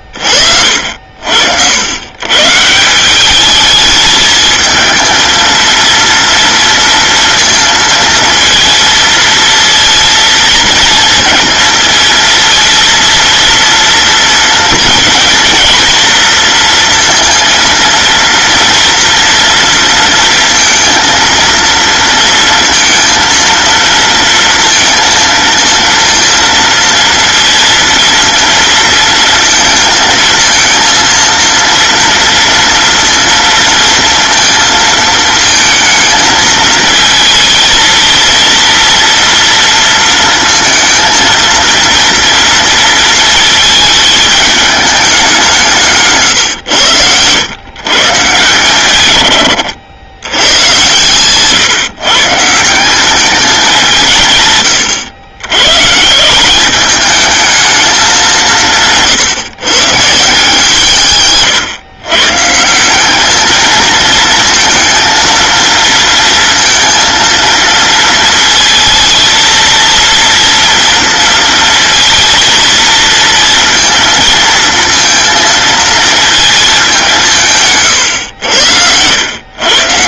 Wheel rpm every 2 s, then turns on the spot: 50, 150, 220, 230, 230, 230, 230, 230, 230, 230, 230, 230, 230, 230, 230, 230, 230, 230, 220, 230, 230, 230, 210, 120, 130, 110, 160, 140, 190, 180, 160, 160, 230, 230, 220, 230, 230, 230, 220, 100.
none